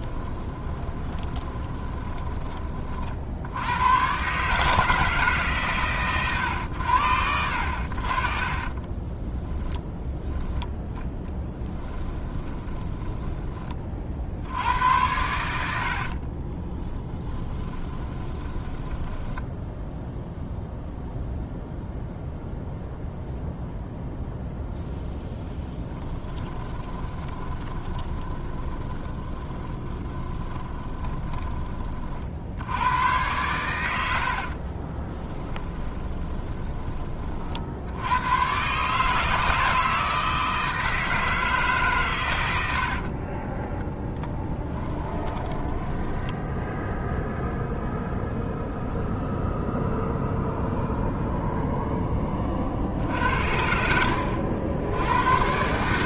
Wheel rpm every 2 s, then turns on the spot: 20, 20, 150, 100, 20, 10, 10, 80, 30, 20, 0, 0, 0, 10, 20, 20, 80, 40, 20, 130, 160, 80, 10, 0, 0, 0, 50, 70.
0-2 8-10 12-14 16-20 26-32 34-36 44-46